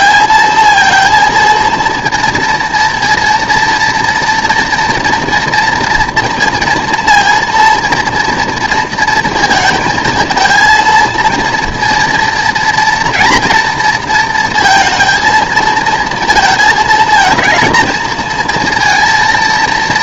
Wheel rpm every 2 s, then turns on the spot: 230, 230, 230, 230, 230, 230, 230, 230, 220, 230.
none